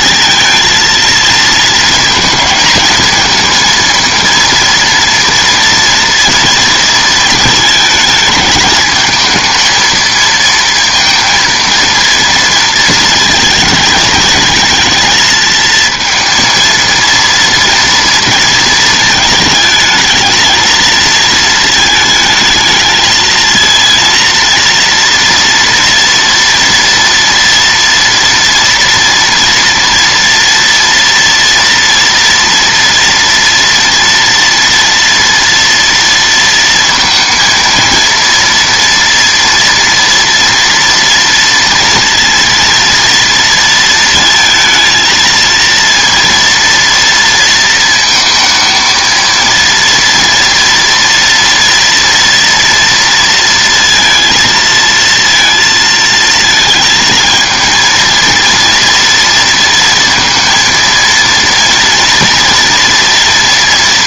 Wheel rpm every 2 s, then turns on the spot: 230, 230, 230, 230, 210, 230, 230, 220, 230, 220, 220, 220, 230, 230, 230, 230, 230, 230, 230, 230, 230, 230, 230, 230, 230, 230, 230, 230, 220, 230, 230, 230.
none